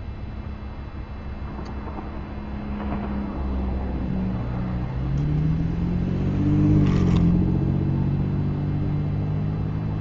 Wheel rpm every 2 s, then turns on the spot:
0, 0, 0, 0, 0.
none